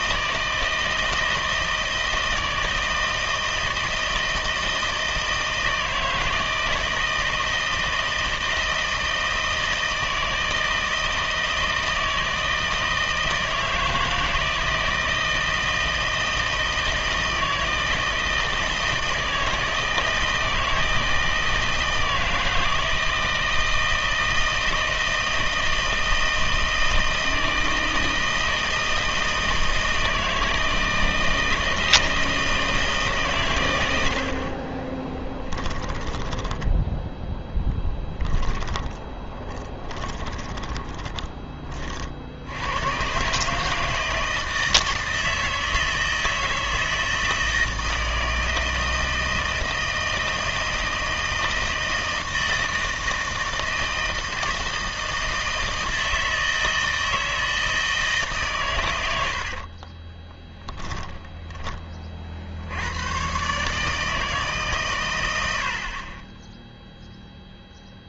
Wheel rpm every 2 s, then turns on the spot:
160, 160, 160, 160, 160, 160, 160, 160, 160, 160, 160, 160, 160, 160, 160, 160, 160, 40, 10, 10, 20, 90, 160, 160, 160, 160, 160, 160, 160, 120, 10, 80, 140, 0.
34-42 60-62